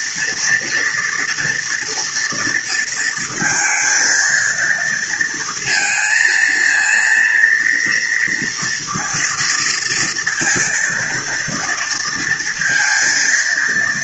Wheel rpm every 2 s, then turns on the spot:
240, 230, 230, 230, 230, 230, 230.
none